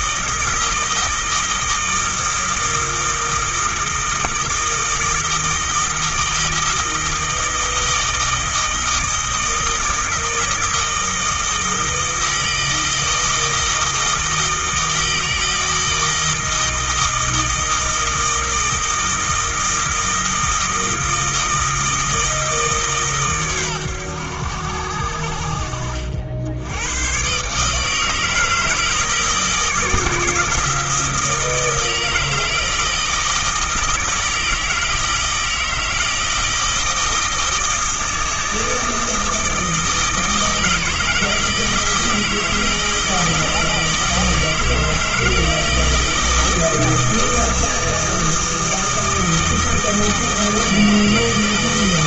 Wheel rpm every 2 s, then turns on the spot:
160, 160, 160, 160, 160, 160, 160, 160, 160, 160, 160, 150, 80, 90, 160, 160, 160, 160, 160, 160, 160, 160, 160, 160, 160, 160.
none